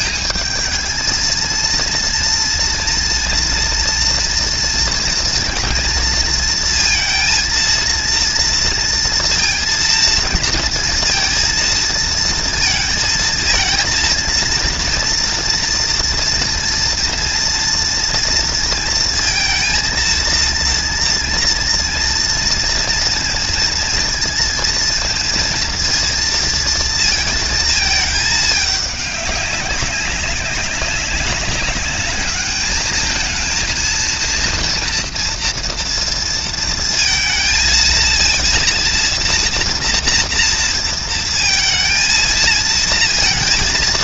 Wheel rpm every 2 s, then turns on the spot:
220, 240, 230, 230, 230, 230, 230, 230, 230, 230, 230, 230, 230, 230, 200, 200, 220, 230, 230, 240, 230, 230.
none